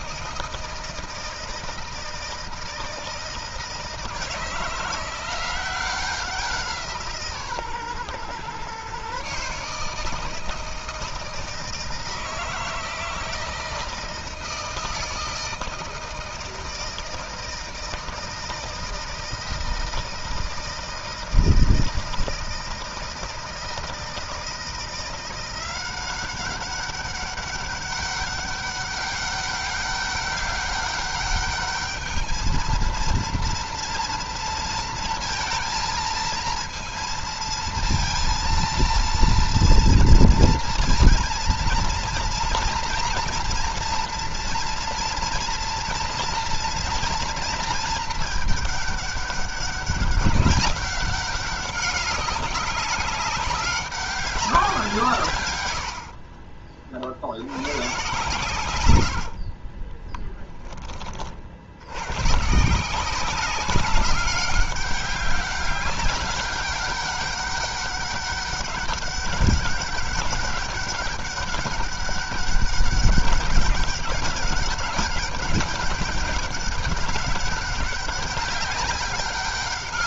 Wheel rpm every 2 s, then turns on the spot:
160, 160, 170, 170, 140, 160, 160, 160, 160, 160, 160, 160, 170, 200, 200, 200, 230, 230, 230, 230, 230, 240, 240, 230, 210, 200, 190, 180, 50, 110, 30, 170, 200, 200, 200, 200, 200, 200, 200, 190.
58-60